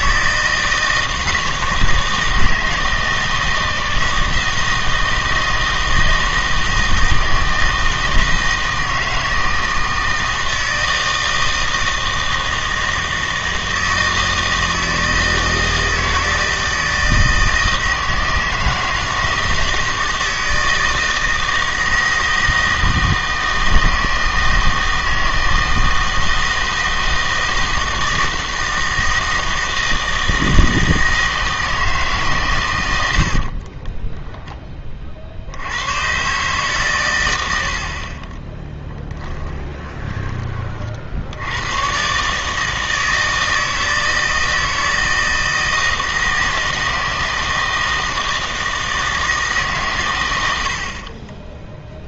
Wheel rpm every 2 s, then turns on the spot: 160, 160, 160, 160, 160, 160, 160, 160, 160, 160, 160, 160, 160, 160, 160, 160, 110, 10, 130, 10, 40, 160, 160, 160, 160, 100.
38-40